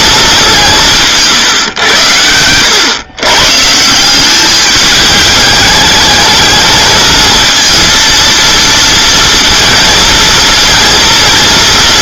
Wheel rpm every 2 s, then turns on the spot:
180, 110, 210, 220, 230, 230.
none